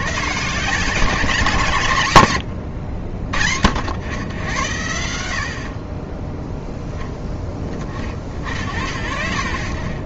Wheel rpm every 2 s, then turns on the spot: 150, 100, 90, 10, 60.
none